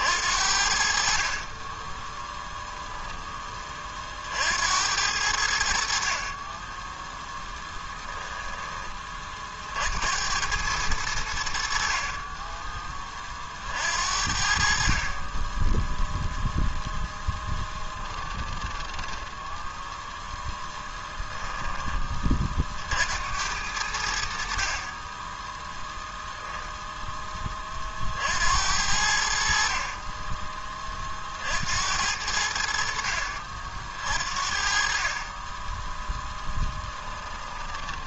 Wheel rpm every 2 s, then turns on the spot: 50, 10, 80, 10, 20, 100, 20, 40, 0, 10, 10, 60, 30, 10, 70, 30, 60, 40, 20.
18-22 36-38